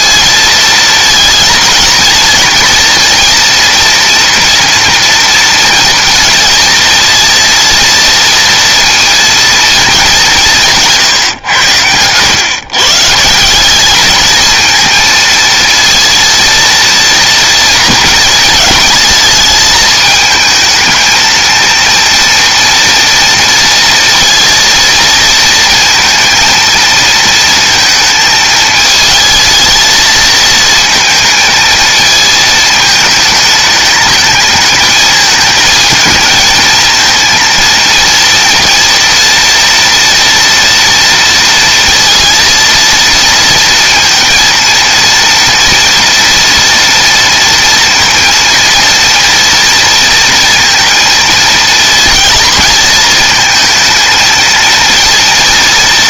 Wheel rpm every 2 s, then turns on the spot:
220, 230, 230, 230, 230, 180, 120, 220, 230, 230, 220, 230, 230, 230, 220, 220, 220, 220, 220, 230, 240, 230, 230, 240, 230, 230, 230, 230.
none